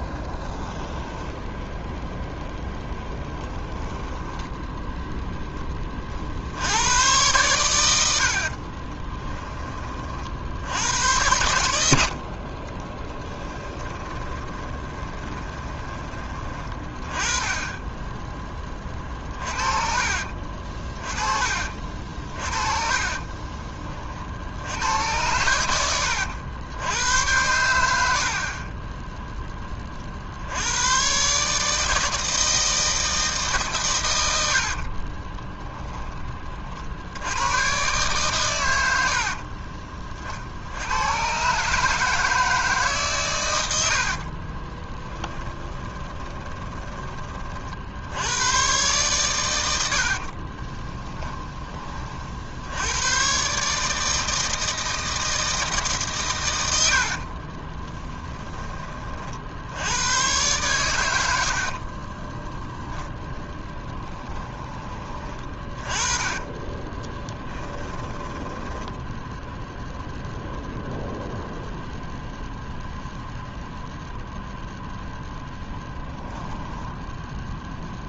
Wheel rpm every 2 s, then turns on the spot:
10, 0, 10, 80, 30, 90, 40, 20, 20, 20, 40, 40, 80, 90, 30, 90, 160, 70, 60, 100, 70, 160, 30, 20, 120, 30, 80, 160, 80, 20, 110, 0, 20, 20, 10, 0, 0, 0, 0.
0-2 8-10 12-16 22-24 28-30 34-36 44-48 50-52 66-70